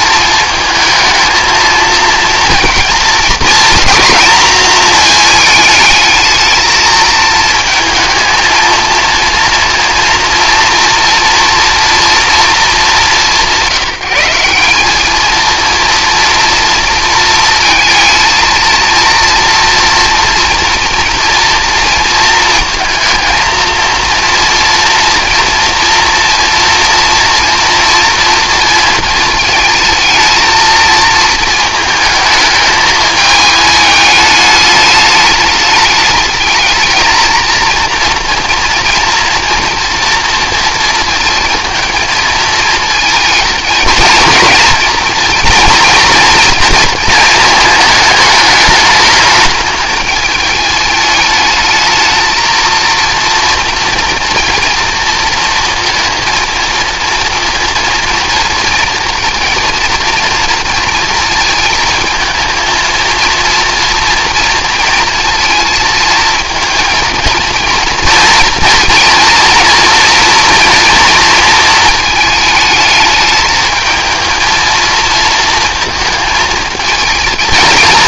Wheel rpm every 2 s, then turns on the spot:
220, 230, 230, 220, 230, 230, 220, 200, 230, 230, 240, 230, 240, 230, 230, 230, 220, 210, 220, 230, 230, 220, 220, 230, 210, 210, 230, 230, 230, 230, 230, 220, 230, 230, 230, 230, 220, 230, 220.
none